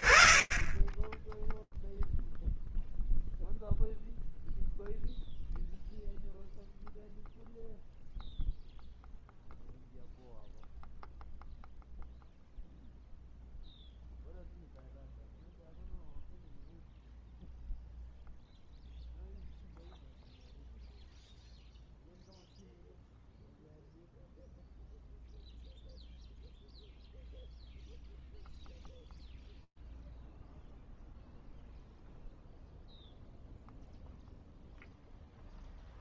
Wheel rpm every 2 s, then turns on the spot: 20, 0, 0, 0, 0, 0, 0, 0, 0, 0, 0, 0, 0, 0, 0, 0, 0, 0.
none